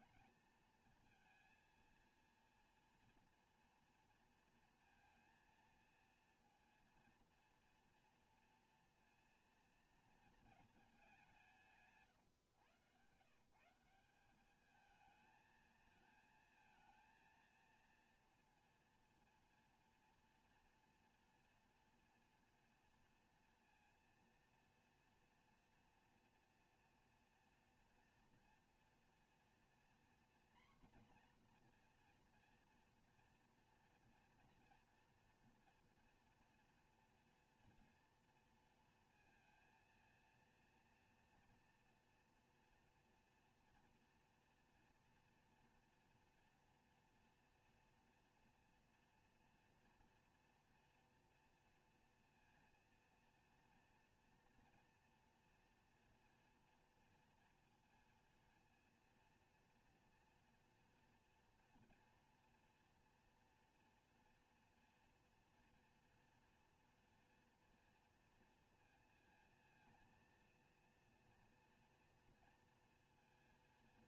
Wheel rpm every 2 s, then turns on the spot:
230, 230, 230, 230, 240, 220, 120, 200, 230, 230, 230, 230, 230, 230, 240, 240, 240, 230, 240, 240, 230, 230, 230, 230, 240, 240, 230, 230, 230, 230, 230, 230, 240, 230, 230, 230, 230.
none